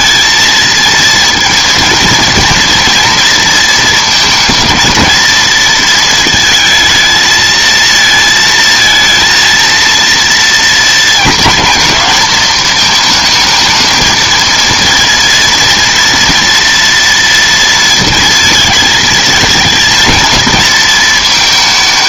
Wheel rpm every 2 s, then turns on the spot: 220, 240, 220, 220, 220, 230, 220, 230, 230, 220, 220.
none